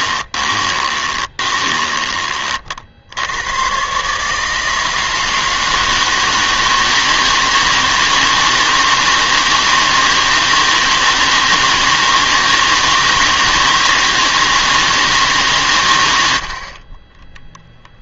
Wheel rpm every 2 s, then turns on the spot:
20, 60, 160, 160, 160, 160, 160, 160, 40.
0-2